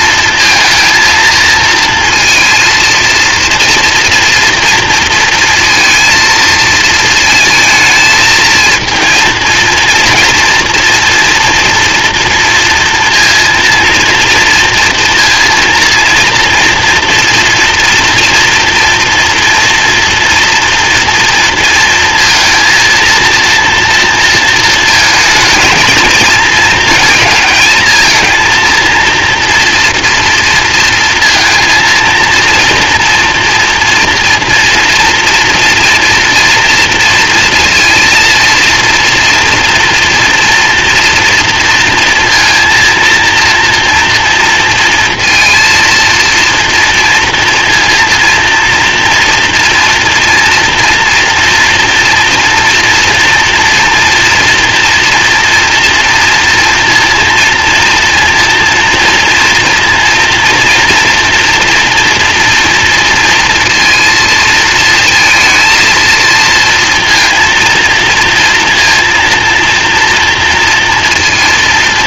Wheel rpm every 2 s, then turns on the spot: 230, 230, 230, 220, 220, 230, 230, 230, 230, 230, 230, 230, 220, 220, 230, 230, 230, 240, 230, 230, 230, 230, 230, 230, 230, 240, 230, 230, 230, 230, 240, 230, 220, 230, 230, 230.
none